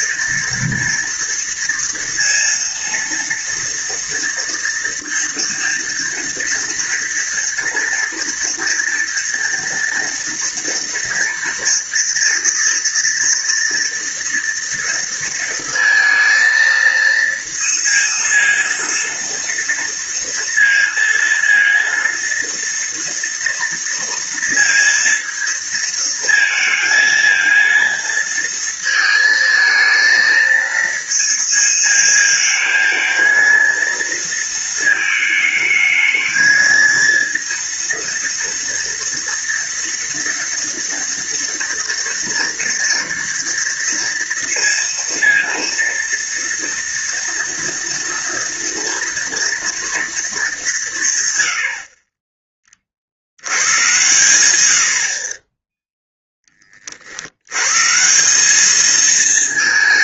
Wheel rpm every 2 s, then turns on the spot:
230, 230, 230, 230, 230, 230, 230, 230, 230, 230, 230, 230, 230, 220, 230, 230, 220, 220, 220, 230, 230, 230, 230, 230, 230, 190, 40, 90, 20, 200.
none